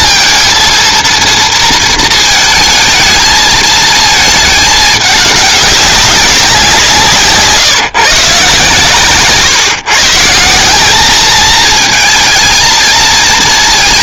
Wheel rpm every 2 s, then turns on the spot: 230, 220, 210, 180, 130, 180, 220.
none